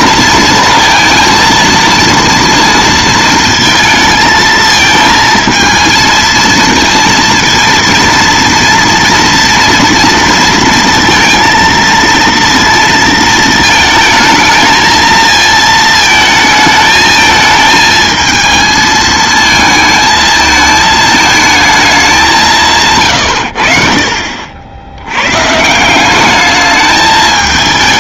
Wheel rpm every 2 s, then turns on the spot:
230, 230, 220, 230, 230, 230, 230, 220, 220, 220, 220, 140, 80, 210.
none